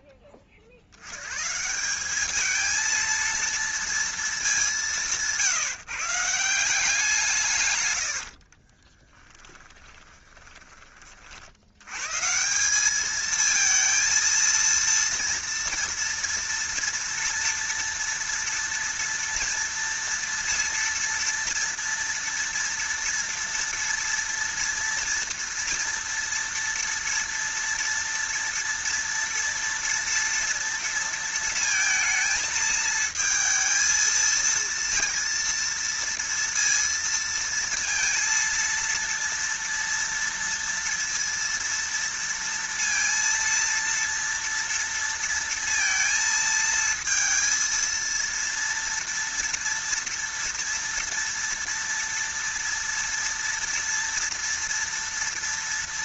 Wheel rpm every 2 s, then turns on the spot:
60, 220, 170, 160, 10, 30, 210, 230, 230, 230, 230, 230, 230, 230, 230, 230, 220, 230, 230, 230, 230, 230, 230, 230, 230, 230, 230, 230.
8-10